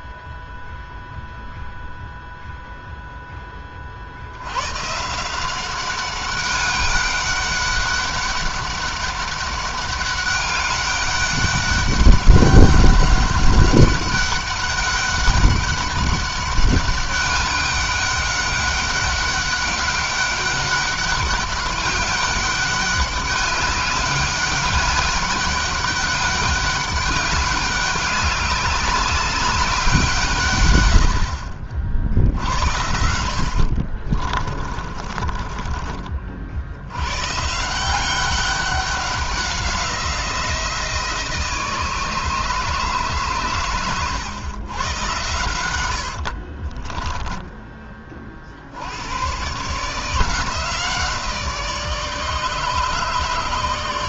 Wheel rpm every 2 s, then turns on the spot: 0, 0, 140, 200, 200, 200, 200, 200, 200, 200, 200, 200, 200, 200, 200, 120, 60, 30, 90, 190, 160, 150, 110, 30, 70, 170, 150.
34-36 46-48